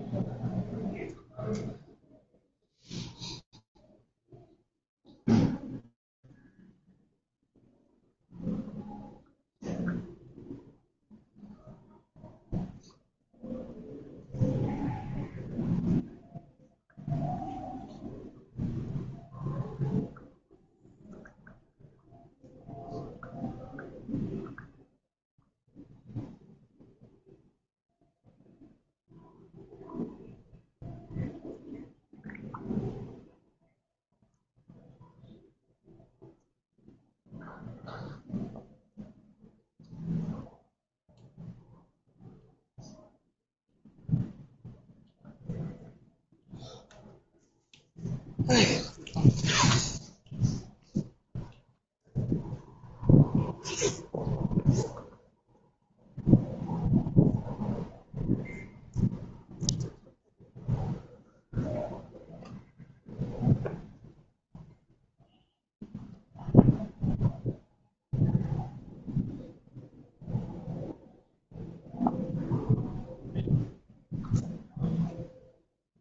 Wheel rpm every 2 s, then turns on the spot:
0, 0, 0, 0, 0, 0, 0, 0, 0, 0, 0, 0, 0, 0, 0, 0, 0, 0, 0, 0, 0, 0, 0, 0, 0, 0, 0, 0, 0, 0, 0, 0, 0, 0, 0, 0, 0, 0.
none